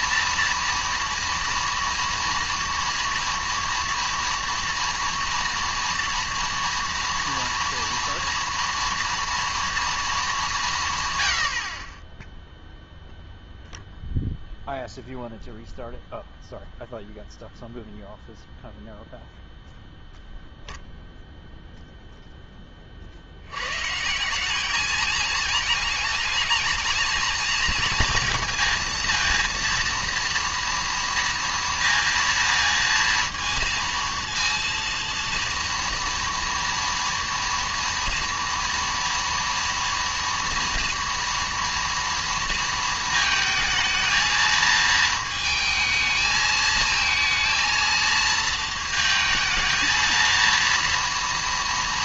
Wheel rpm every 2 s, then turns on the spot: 230, 230, 230, 230, 230, 190, 0, 0, 0, 0, 0, 10, 200, 220, 230, 230, 230, 230, 230, 230, 230, 230, 220, 220, 220, 230.
none